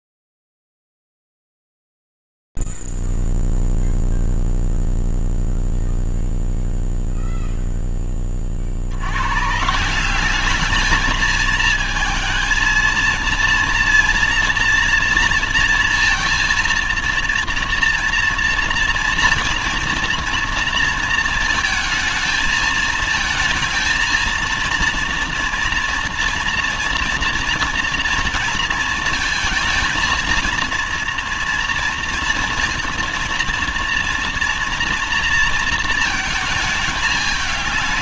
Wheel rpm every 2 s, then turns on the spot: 0, 0, 0, 0, 10, 170, 220, 230, 230, 230, 230, 220, 220, 230, 230, 230, 230, 240, 220.
none